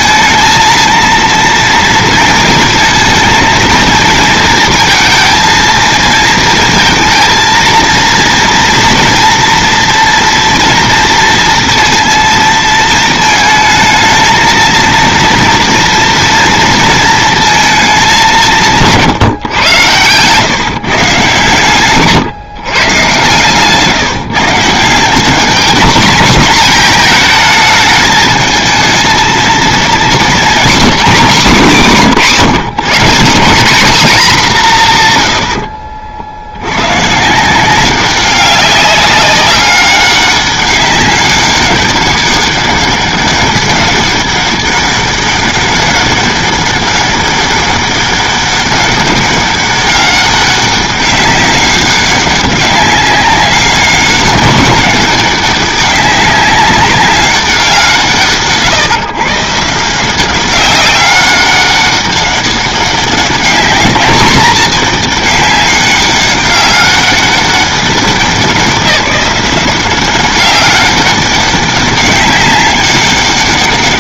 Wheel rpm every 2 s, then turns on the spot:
230, 230, 220, 230, 230, 240, 230, 220, 230, 170, 140, 140, 160, 210, 220, 250, 170, 200, 90, 200, 200, 200, 200, 200, 200, 200, 190, 190, 190, 140, 190, 200, 220, 200, 190, 190, 200.
none